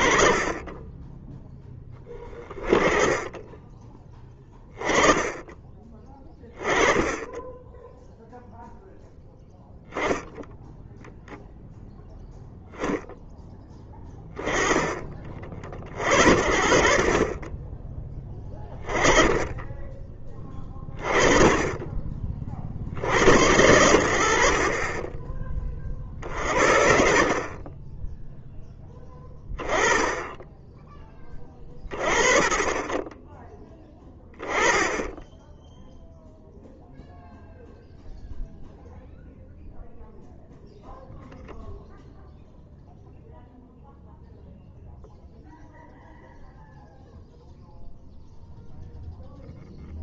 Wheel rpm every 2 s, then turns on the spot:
10, 20, 20, 20, 0, 0, 0, 30, 50, 20, 20, 80, 30, 50, 10, 20, 30, 10, 0, 0, 0, 0, 0, 0, 0.
none